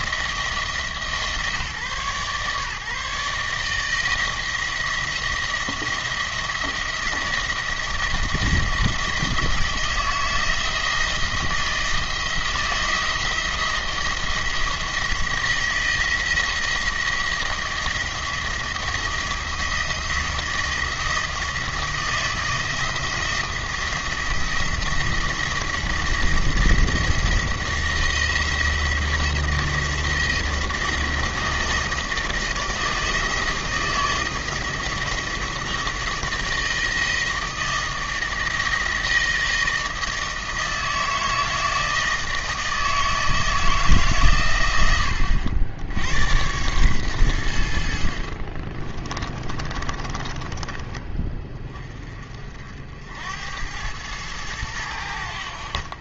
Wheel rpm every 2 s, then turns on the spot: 160, 140, 170, 170, 170, 160, 170, 170, 170, 170, 170, 160, 170, 170, 170, 170, 160, 170, 160, 160, 160, 160, 110, 110, 30, 30, 60, 110.
48-52